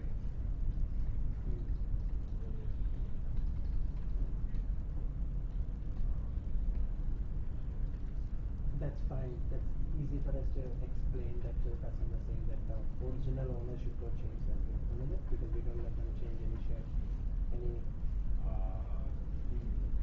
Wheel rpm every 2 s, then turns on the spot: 0, 0, 0, 0, 0, 0, 0, 0, 0, 0.
none